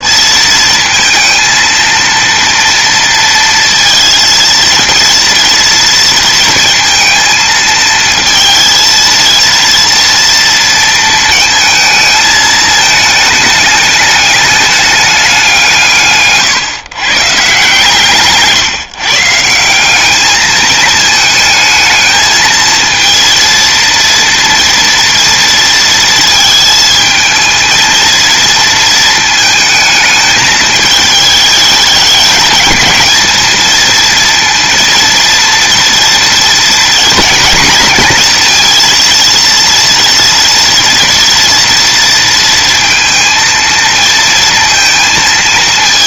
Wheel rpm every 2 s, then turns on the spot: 230, 230, 230, 230, 230, 230, 220, 210, 140, 160, 210, 230, 230, 220, 230, 210, 220, 230, 240, 230, 230, 230, 230.
none